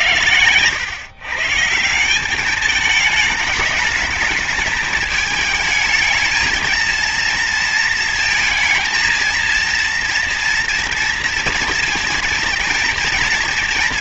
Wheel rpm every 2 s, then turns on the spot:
110, 210, 220, 220, 230, 230, 230.
none